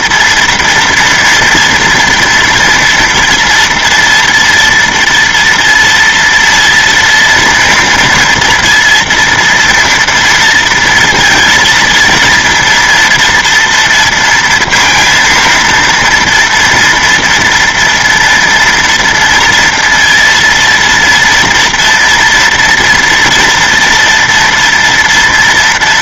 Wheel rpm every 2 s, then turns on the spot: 230, 230, 230, 230, 230, 230, 230, 230, 230, 230, 230, 240, 230.
none